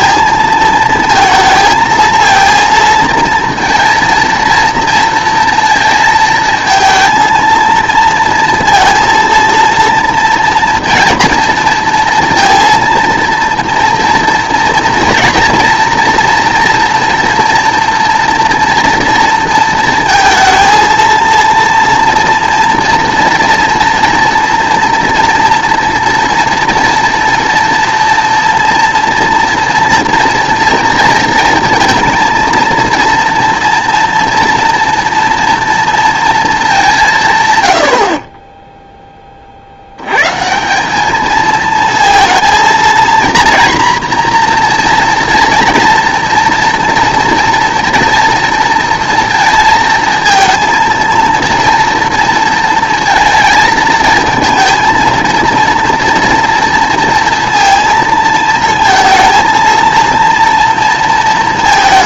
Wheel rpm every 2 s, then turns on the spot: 230, 230, 230, 230, 230, 230, 230, 230, 230, 230, 220, 230, 230, 240, 230, 230, 230, 240, 200, 10, 170, 230, 240, 230, 230, 230, 230, 220, 230, 220, 230.
38-40